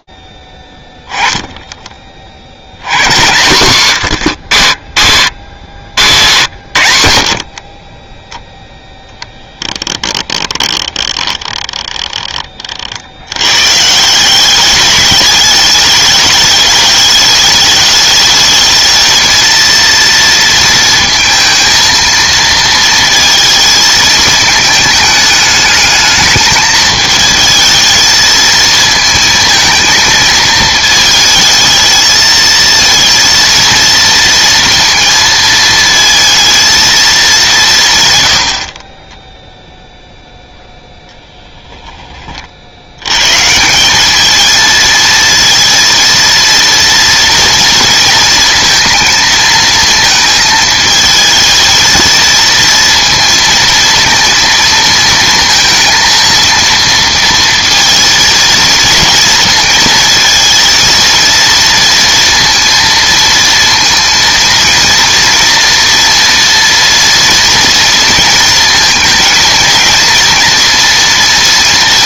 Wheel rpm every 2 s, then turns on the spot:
10, 120, 70, 50, 10, 20, 100, 210, 210, 230, 220, 230, 210, 220, 230, 220, 230, 230, 200, 10, 0, 120, 230, 230, 230, 220, 230, 230, 230, 220, 230, 230, 230, 230, 230, 230.
8-12